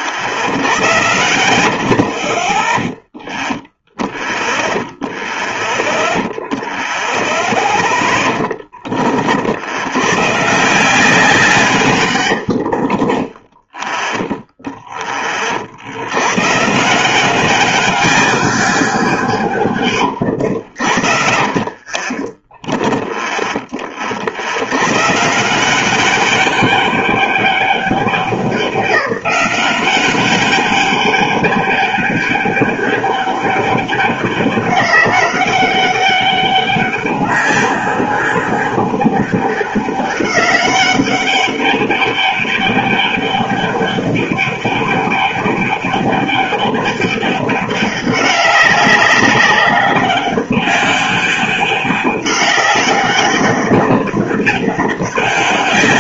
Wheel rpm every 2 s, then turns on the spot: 40, 10, 10, 0, 30, 170, 50, 10, 150, 190, 80, 20, 100, 200, 190, 200, 200, 200, 210, 200, 200, 200, 200, 200, 200, 200, 200, 200.
12-14 20-24